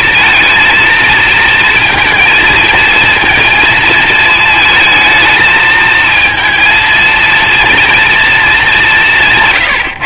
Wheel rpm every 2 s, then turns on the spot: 230, 230, 220, 230, 210.
none